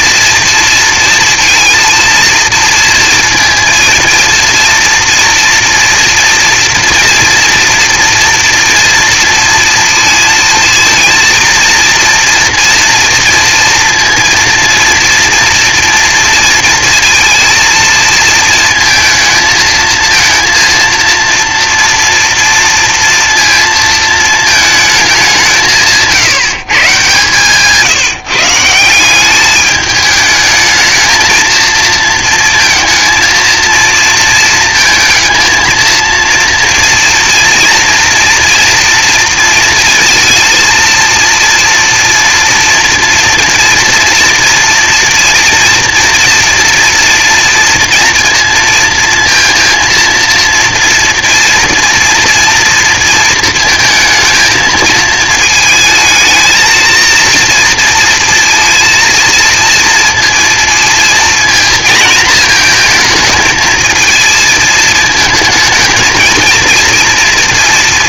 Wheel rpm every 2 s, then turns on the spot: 230, 230, 230, 240, 240, 230, 230, 230, 230, 230, 230, 230, 220, 150, 170, 220, 230, 230, 230, 230, 230, 230, 230, 230, 230, 230, 230, 220, 230, 230, 230, 230, 220, 230.
none